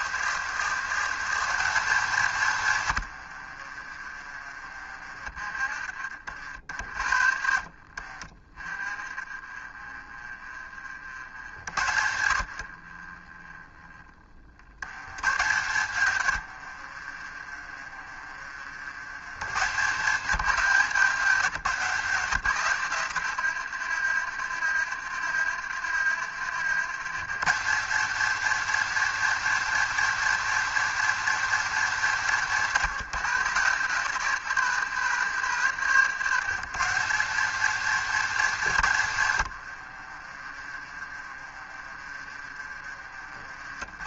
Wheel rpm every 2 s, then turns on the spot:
160, 110, 40, 50, 30, 60, 50, 100, 50, 80, 170, 120, 70, 120, 220, 220, 150, 120, 170, 130, 30, 40.
2-4 16-18 40-44